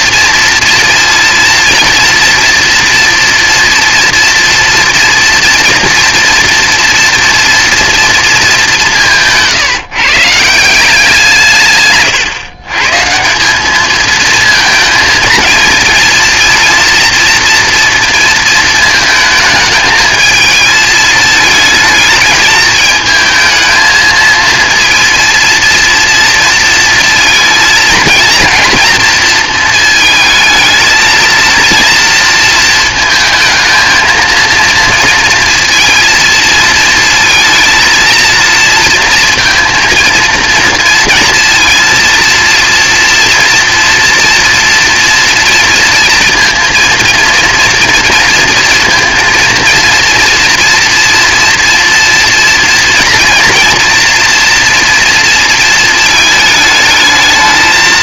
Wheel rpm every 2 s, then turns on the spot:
230, 240, 240, 230, 200, 170, 130, 220, 230, 220, 220, 220, 230, 230, 230, 230, 220, 230, 230, 230, 230, 240, 230, 230, 230, 230, 240, 230, 220.
none